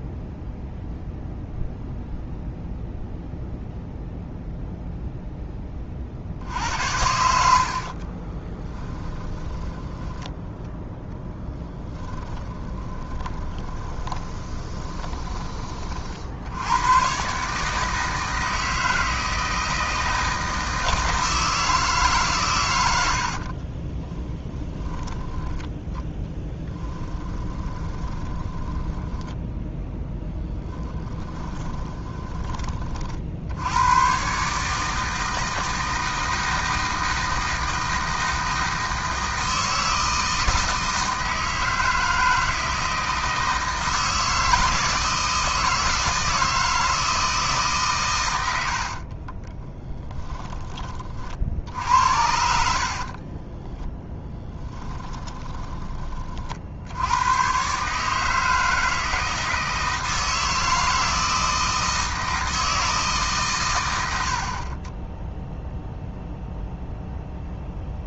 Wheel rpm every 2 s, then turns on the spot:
0, 0, 0, 80, 10, 10, 30, 20, 100, 160, 160, 100, 10, 10, 10, 10, 40, 150, 160, 160, 160, 160, 160, 160, 60, 20, 60, 10, 60, 160, 160, 160, 20, 0.
6-10 12-16 26-32 48-50 52-56